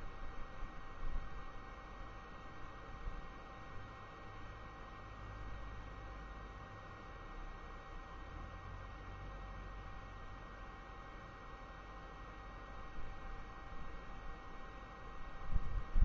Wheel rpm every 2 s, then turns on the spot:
0, 0, 0, 0, 0, 0, 0, 0.
none